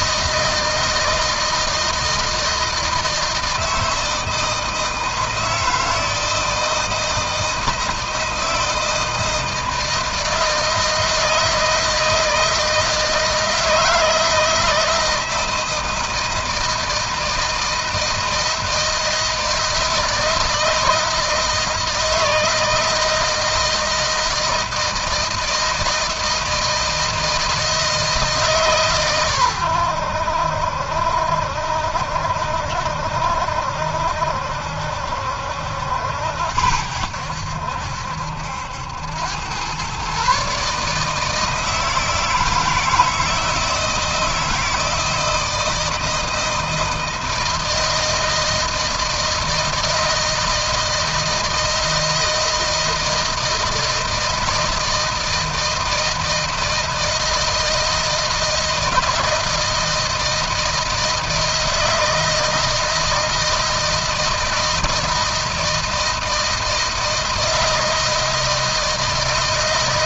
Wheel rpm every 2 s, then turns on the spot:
160, 160, 160, 160, 160, 160, 160, 160, 160, 160, 160, 160, 160, 160, 130, 70, 70, 70, 80, 90, 150, 160, 160, 160, 160, 160, 160, 160, 160, 160, 160, 160, 160, 160, 160.
none